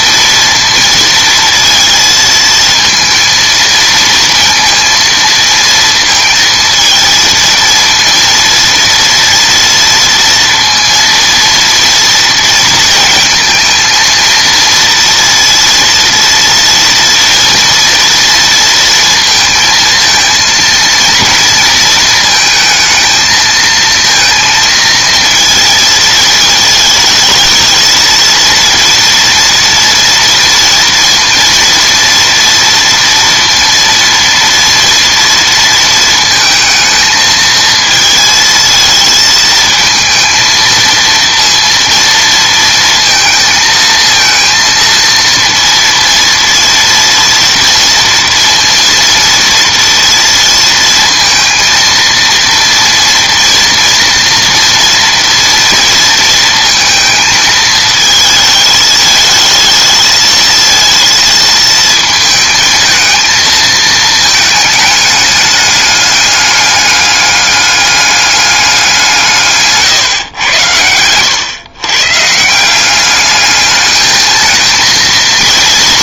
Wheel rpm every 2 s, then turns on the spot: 230, 230, 230, 230, 230, 230, 230, 230, 230, 230, 230, 220, 230, 220, 230, 230, 230, 230, 220, 230, 230, 230, 230, 230, 230, 230, 230, 240, 220, 220, 220, 220, 220, 200, 190, 90, 170, 220.
none